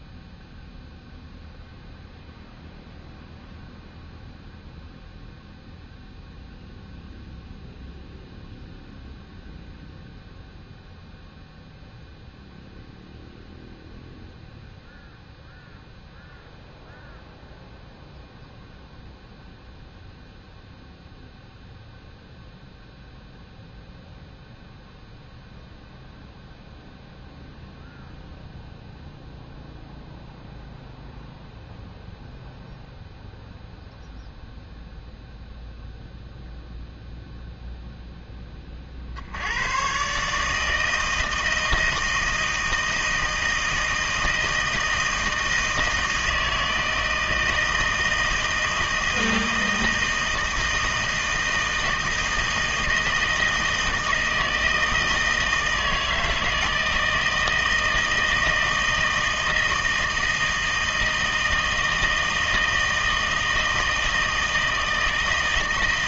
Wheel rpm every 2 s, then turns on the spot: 0, 0, 0, 0, 0, 0, 0, 0, 0, 0, 0, 0, 0, 0, 0, 0, 0, 0, 0, 30, 160, 160, 160, 160, 160, 160, 160, 160, 160, 160, 160, 160, 160.
none